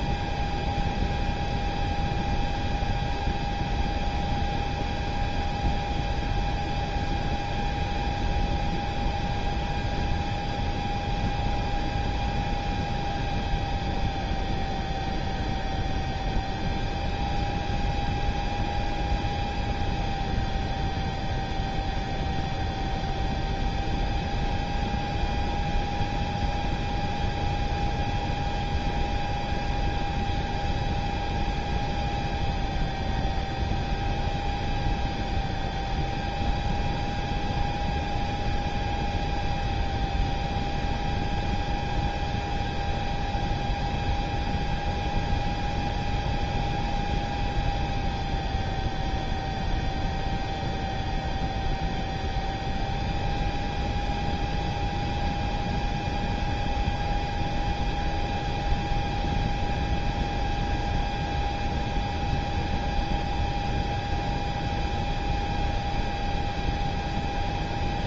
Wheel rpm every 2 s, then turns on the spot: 0, 0, 0, 0, 0, 0, 0, 0, 0, 0, 0, 0, 0, 0, 0, 0, 0, 0, 0, 0, 0, 0, 0, 0, 0, 0, 0, 0, 0, 0, 0, 0, 0, 0.
none